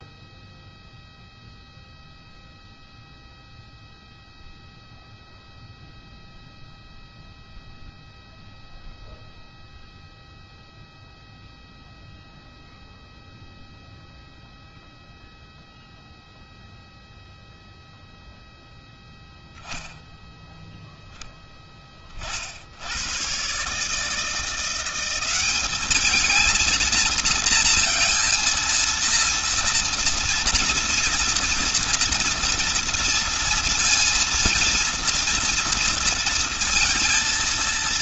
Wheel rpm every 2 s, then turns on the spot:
0, 0, 0, 0, 0, 0, 0, 0, 0, 0, 0, 70, 170, 220, 230, 230, 230, 230, 230.
none